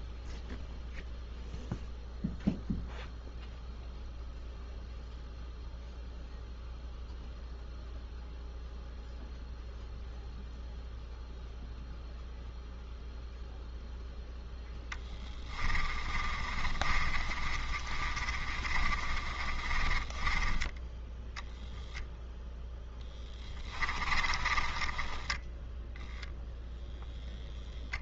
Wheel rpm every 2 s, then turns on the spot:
0, 0, 0, 0, 0, 0, 0, 10, 30, 30, 10, 0, 20, 0.
16-22 24-26